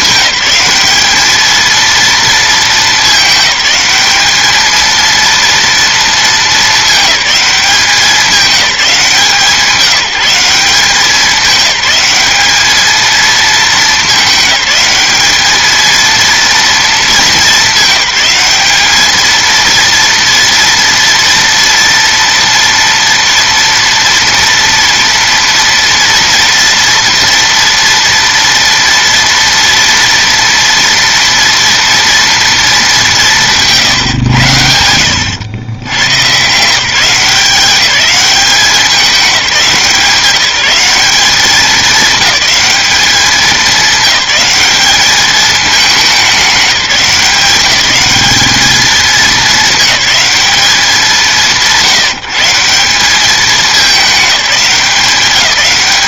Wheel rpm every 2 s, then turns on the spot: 200, 220, 210, 220, 200, 190, 200, 210, 230, 200, 230, 230, 230, 230, 230, 230, 220, 90, 130, 200, 180, 200, 210, 200, 210, 210, 160, 200.
none